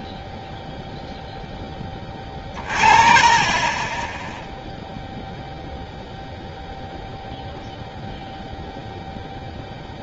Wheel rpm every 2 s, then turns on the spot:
0, 30, 0, 0, 0.
none